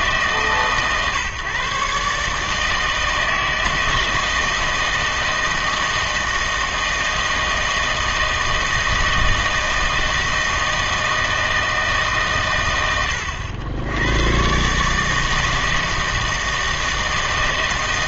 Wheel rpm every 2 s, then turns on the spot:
140, 160, 160, 160, 160, 160, 110, 140, 160.
none